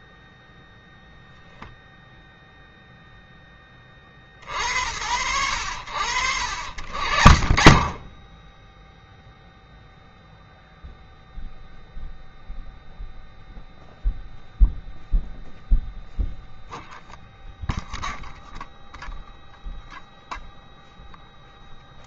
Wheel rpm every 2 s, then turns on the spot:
0, 10, 90, 60, 0, 0, 0, 0, 0, 0, 0.
none